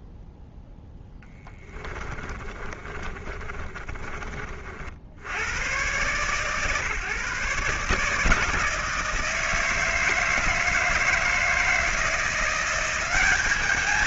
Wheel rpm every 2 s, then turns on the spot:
0, 30, 40, 130, 160, 160, 180.
2-4